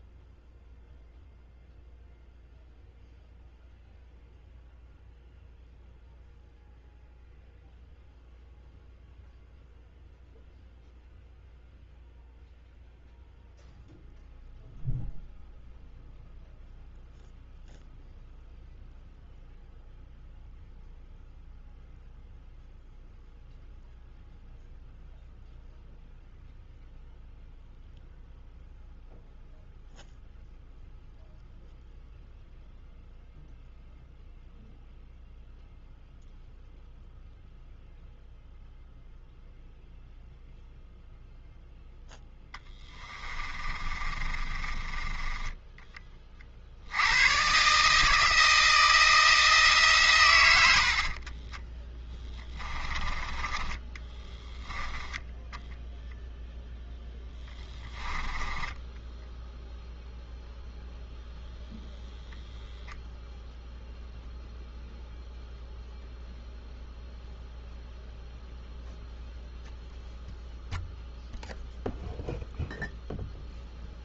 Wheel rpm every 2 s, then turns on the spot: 0, 0, 0, 0, 0, 0, 0, 0, 0, 0, 0, 0, 0, 0, 0, 0, 0, 0, 0, 0, 0, 30, 30, 50, 160, 100, 20, 10, 0, 10, 0, 0, 0, 0, 0, 0, 0.
42-46 52-54 58-60